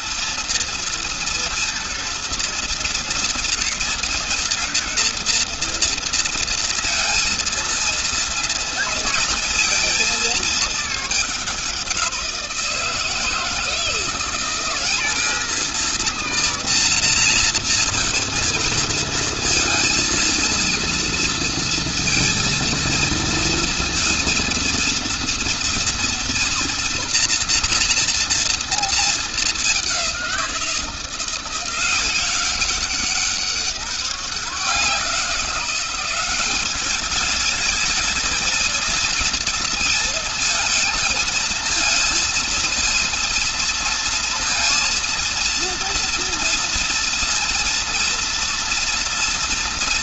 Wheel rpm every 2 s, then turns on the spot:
230, 230, 230, 230, 230, 210, 160, 210, 230, 230, 230, 230, 230, 240, 220, 170, 190, 180, 210, 230, 220, 230, 230, 230, 230.
none